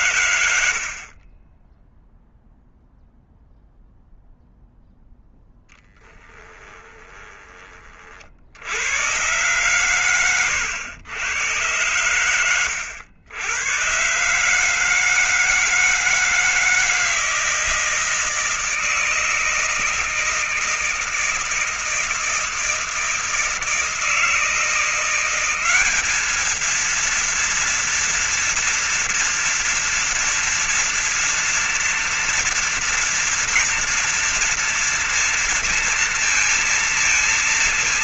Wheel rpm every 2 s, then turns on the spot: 100, 0, 0, 10, 50, 120, 100, 130, 160, 160, 160, 160, 160, 210, 230, 230, 230, 230, 230.
0-2 6-8